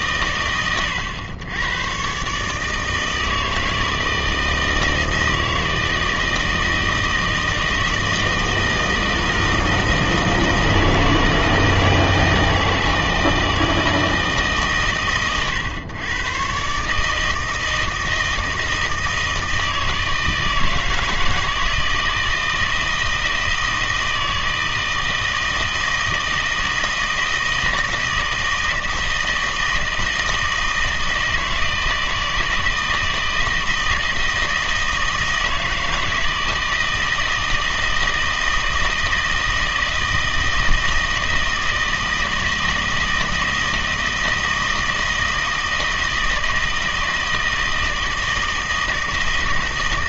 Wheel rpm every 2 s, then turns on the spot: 100, 150, 160, 160, 160, 160, 160, 140, 140, 160, 160, 160, 160, 160, 160, 160, 160, 160, 160, 160, 160, 160, 160, 160, 160.
none